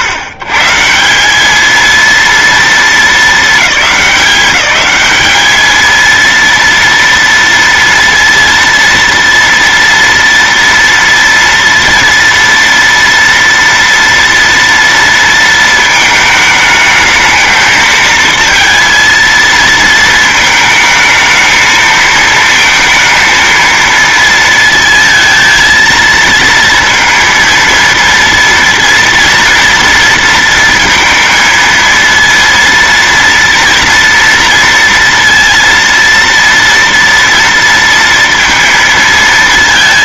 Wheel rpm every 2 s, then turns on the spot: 150, 230, 200, 230, 230, 230, 230, 230, 220, 230, 220, 230, 230, 230, 230, 230, 230, 230, 230, 230.
none